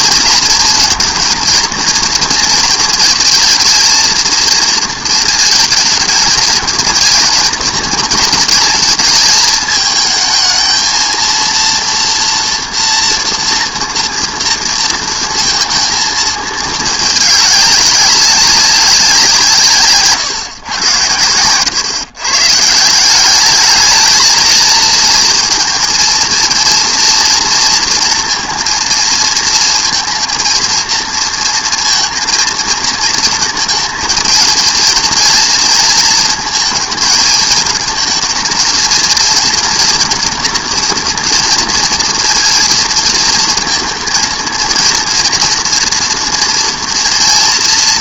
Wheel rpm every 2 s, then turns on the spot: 230, 230, 230, 220, 220, 220, 230, 230, 220, 200, 130, 150, 230, 230, 230, 230, 220, 230, 220, 230, 230, 230, 230, 240.
none